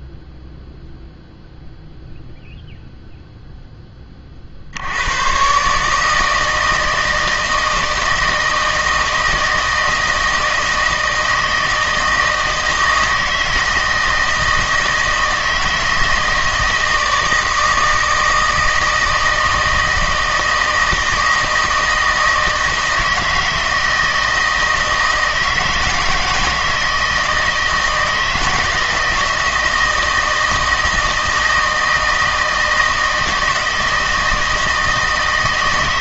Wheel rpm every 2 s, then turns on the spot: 0, 0, 60, 160, 160, 160, 160, 160, 160, 160, 160, 160, 160, 160, 160, 160, 160, 160.
none